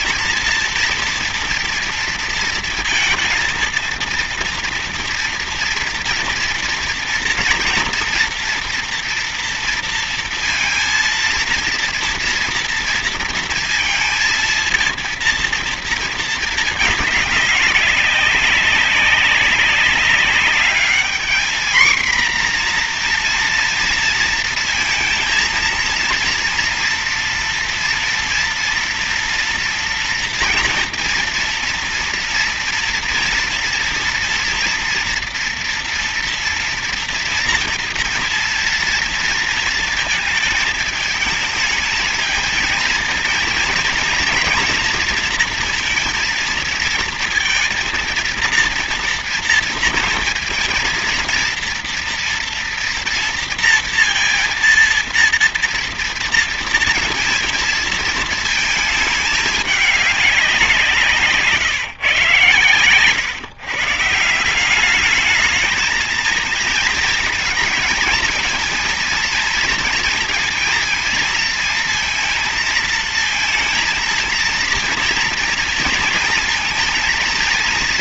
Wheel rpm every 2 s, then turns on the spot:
230, 230, 230, 230, 230, 230, 230, 230, 220, 190, 200, 240, 230, 230, 240, 230, 230, 240, 230, 230, 230, 220, 230, 230, 230, 230, 230, 230, 230, 220, 190, 120, 180, 220, 220, 230, 230, 230, 220.
none